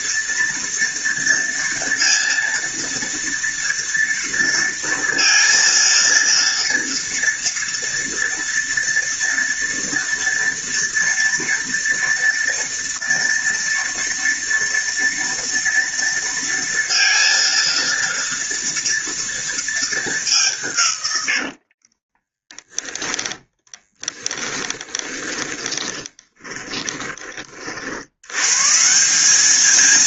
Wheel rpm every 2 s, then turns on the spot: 230, 230, 230, 230, 230, 230, 230, 230, 230, 230, 210, 20, 20, 20, 160.
22-28